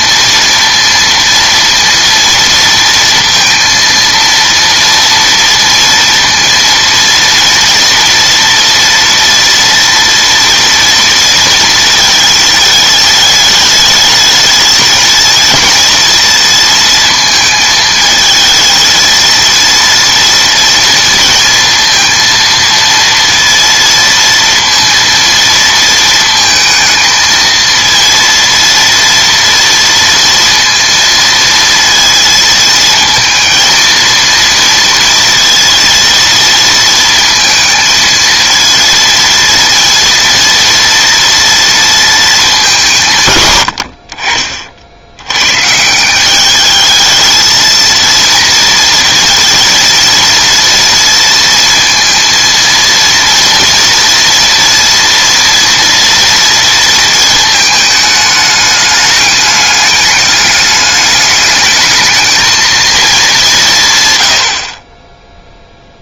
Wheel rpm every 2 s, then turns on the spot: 230, 230, 230, 230, 240, 230, 220, 220, 230, 220, 230, 230, 230, 220, 230, 230, 230, 230, 230, 230, 230, 190, 50, 200, 230, 230, 230, 230, 230, 210, 210, 220, 40.
none